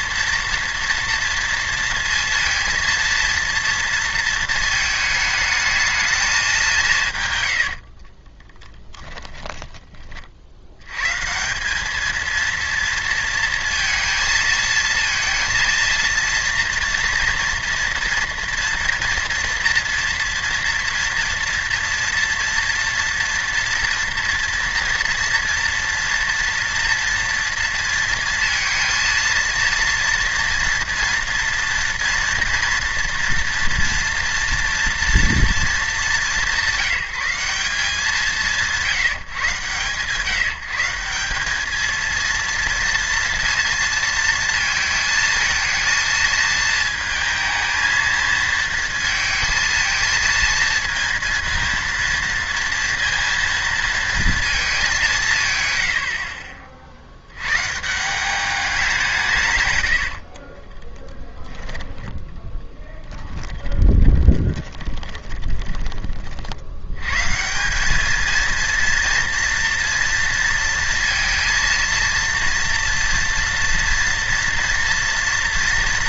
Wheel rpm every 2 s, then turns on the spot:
230, 230, 220, 180, 20, 90, 230, 230, 230, 230, 240, 230, 230, 240, 230, 240, 240, 240, 180, 150, 160, 230, 230, 220, 230, 230, 230, 210, 40, 190, 30, 10, 20, 70, 230, 230, 230, 230.
8-10 60-66